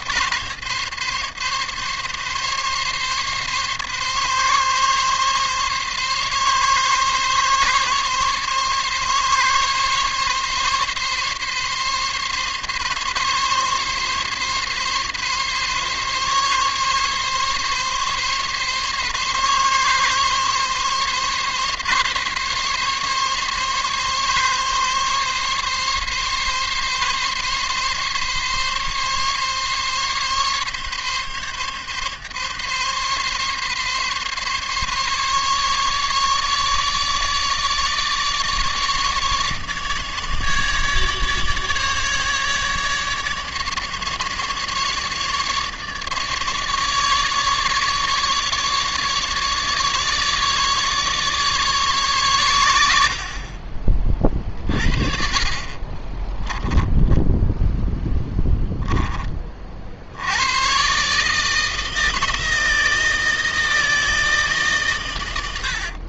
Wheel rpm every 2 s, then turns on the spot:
140, 140, 140, 140, 140, 140, 140, 140, 140, 140, 140, 140, 140, 140, 140, 140, 140, 140, 150, 150, 150, 150, 150, 150, 150, 150, 100, 40, 10, 10, 110, 160, 140.
none